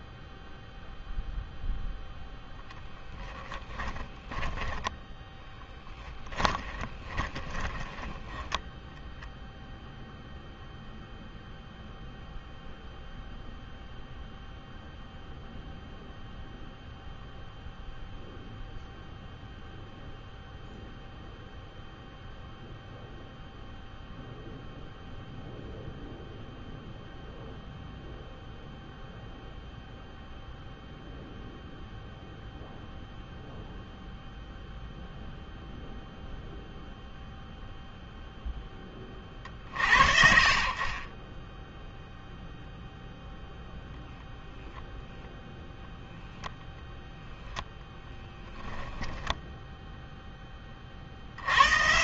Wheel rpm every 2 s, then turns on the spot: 0, 10, 10, 10, 0, 0, 0, 0, 0, 0, 0, 0, 0, 0, 0, 0, 0, 0, 0, 40, 0, 0, 0, 20, 10, 100.
2-8 46-48